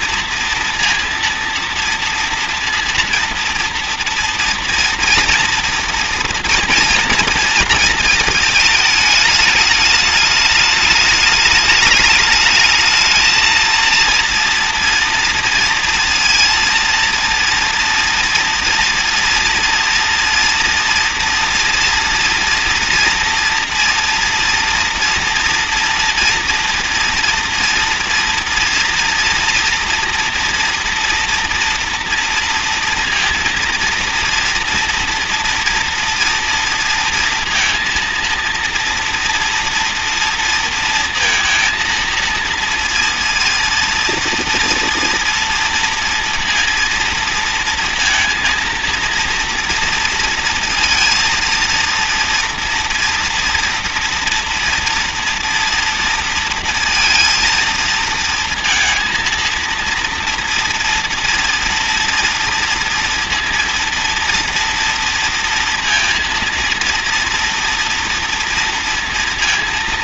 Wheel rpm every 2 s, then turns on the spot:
230, 230, 230, 240, 230, 210, 210, 230, 230, 230, 230, 230, 230, 240, 230, 230, 230, 230, 240, 230, 230, 230, 230, 230, 230, 230, 230, 240, 230, 230, 230, 230, 230, 230, 230.
none